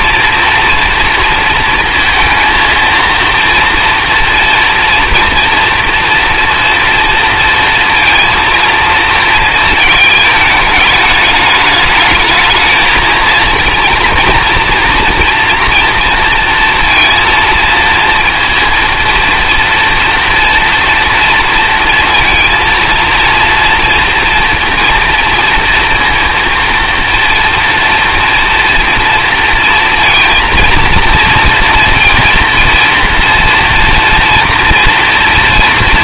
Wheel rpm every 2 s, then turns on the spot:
230, 230, 230, 230, 230, 210, 220, 230, 230, 230, 230, 230, 230, 230, 230, 230, 230, 230.
none